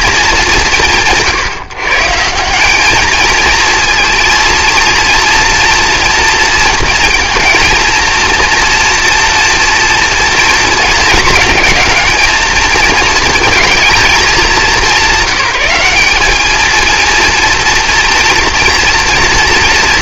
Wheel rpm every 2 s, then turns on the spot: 190, 190, 230, 230, 230, 230, 220, 190, 220, 230.
none